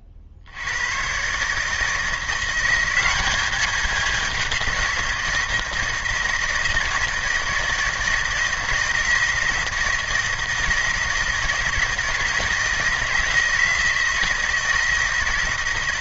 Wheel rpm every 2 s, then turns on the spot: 50, 180, 180, 160, 160, 160, 160, 160.
none